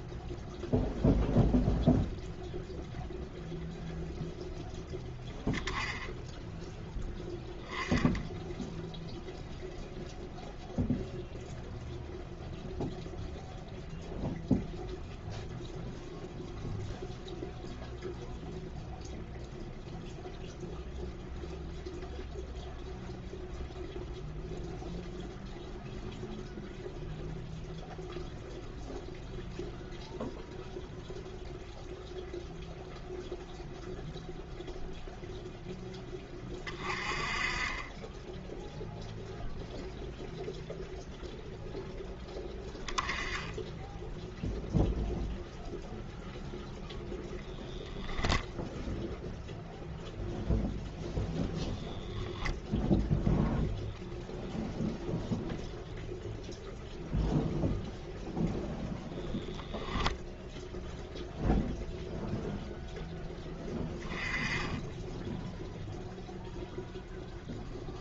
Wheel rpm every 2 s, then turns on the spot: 0, 0, 0, 10, 0, 0, 0, 0, 0, 0, 0, 0, 0, 0, 0, 0, 0, 0, 20, 0, 0, 10, 0, 0, 0, 0, 0, 0, 0, 0, 0, 0, 10, 0.
none